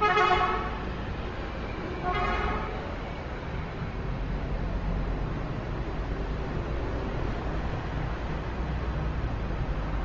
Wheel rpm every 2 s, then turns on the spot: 0, 0, 0, 0, 0.
none